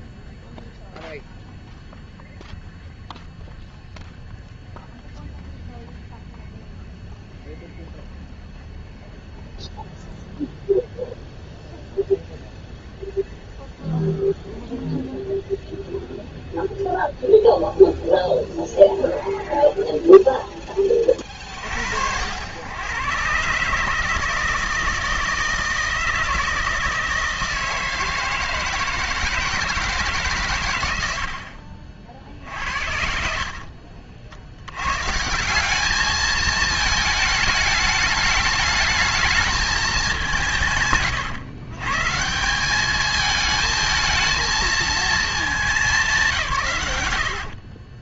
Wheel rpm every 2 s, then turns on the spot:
0, 0, 0, 0, 0, 0, 0, 0, 0, 0, 20, 110, 160, 160, 160, 110, 50, 110, 220, 220, 140, 200, 220, 110.
none